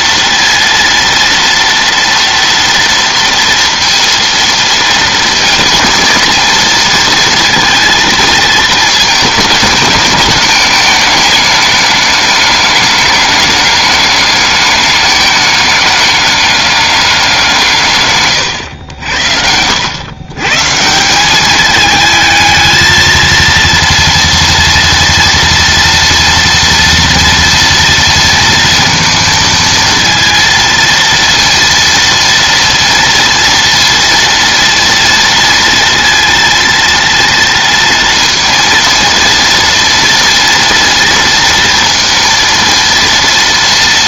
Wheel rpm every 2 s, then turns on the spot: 230, 230, 230, 230, 220, 210, 200, 210, 200, 100, 160, 220, 230, 230, 230, 230, 230, 230, 230, 230, 230, 230.
none